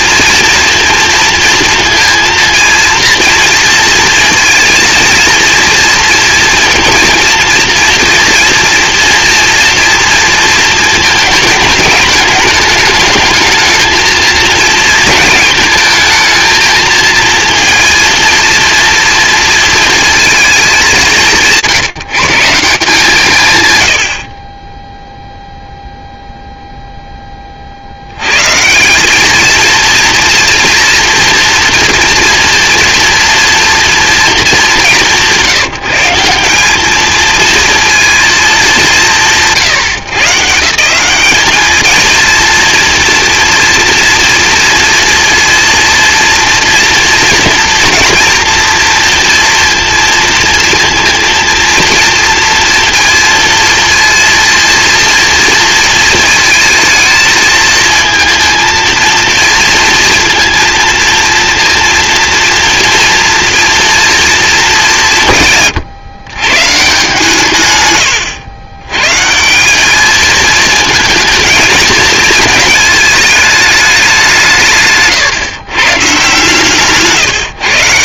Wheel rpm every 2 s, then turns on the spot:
240, 230, 230, 230, 230, 230, 210, 220, 220, 230, 200, 170, 10, 0, 160, 230, 230, 220, 190, 200, 180, 240, 230, 230, 230, 230, 230, 230, 220, 230, 230, 230, 200, 150, 120, 220, 220, 140, 150.
none